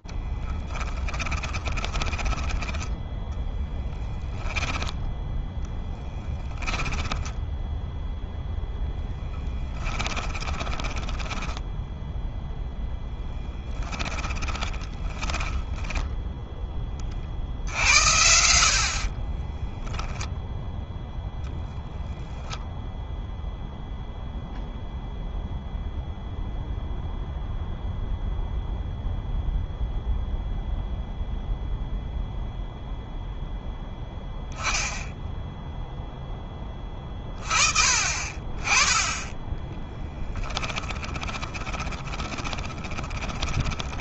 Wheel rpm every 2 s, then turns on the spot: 0, 20, 10, 10, 10, 10, 0, 20, 10, 50, 0, 0, 0, 0, 0, 0, 0, 0, 30, 20, 20, 10.
2-4 6-8 10-12 14-16 38-44